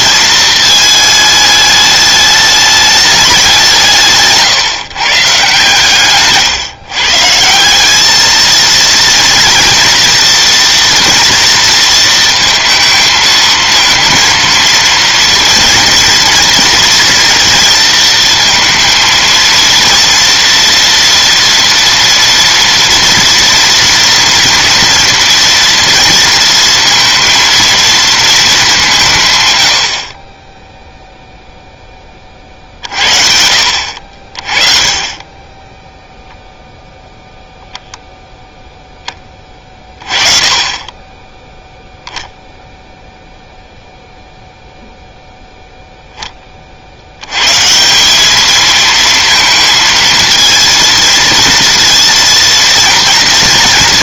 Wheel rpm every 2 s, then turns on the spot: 220, 210, 140, 140, 220, 230, 220, 230, 230, 230, 240, 240, 230, 230, 190, 0, 70, 30, 0, 10, 10, 0, 0, 20, 210, 230, 230.
none